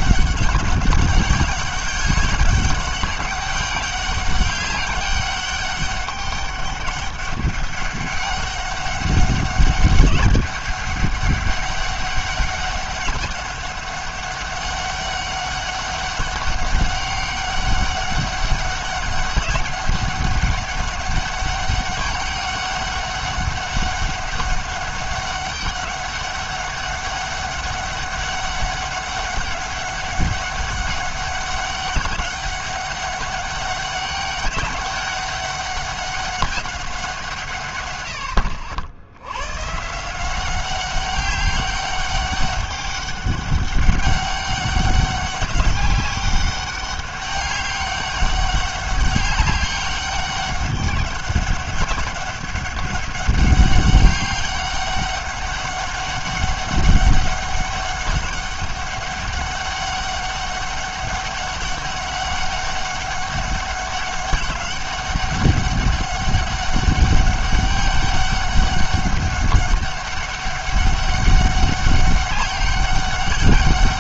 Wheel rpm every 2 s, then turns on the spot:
200, 200, 200, 200, 200, 200, 200, 200, 200, 200, 200, 200, 200, 200, 200, 200, 200, 200, 190, 70, 190, 200, 200, 200, 200, 200, 200, 200, 200, 200, 200, 200, 200, 200, 200, 200, 190.
none